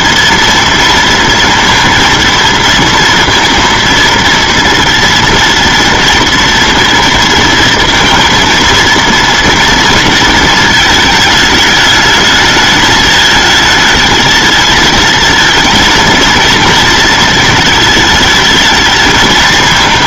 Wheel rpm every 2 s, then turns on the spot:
230, 230, 230, 230, 230, 230, 220, 220, 230, 220.
none